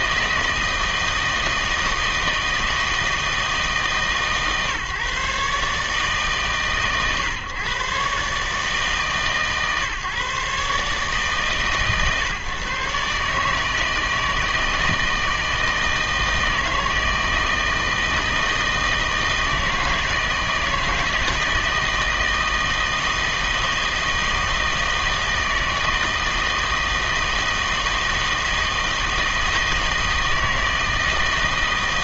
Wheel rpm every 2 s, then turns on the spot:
160, 160, 140, 140, 150, 140, 130, 160, 160, 160, 160, 160, 160, 160, 160, 160.
none